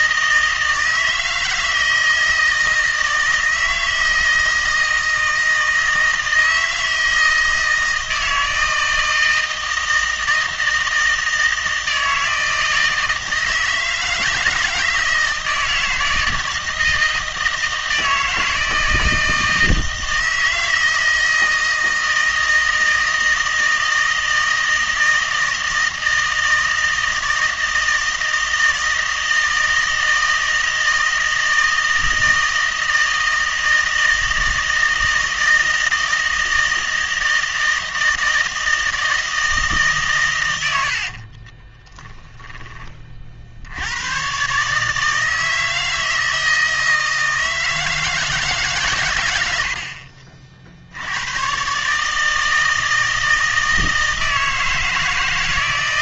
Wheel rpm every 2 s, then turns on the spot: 160, 160, 160, 160, 160, 160, 160, 160, 160, 160, 160, 160, 160, 160, 160, 160, 160, 160, 160, 160, 90, 20, 140, 160, 140, 60, 160, 160.
40-42